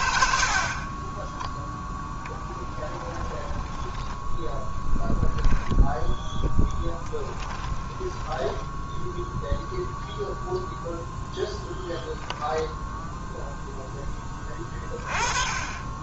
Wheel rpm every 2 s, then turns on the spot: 40, 30, 10, 10, 0, 0, 0, 20.
2-4 6-8